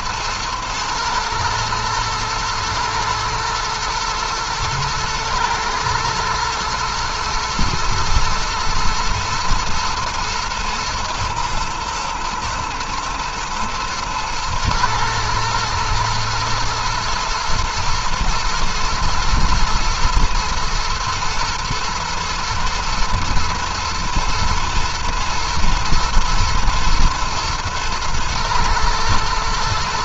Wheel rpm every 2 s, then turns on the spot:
110, 120, 110, 110, 110, 110, 120, 110, 110, 110, 120, 110, 110, 110, 110.
none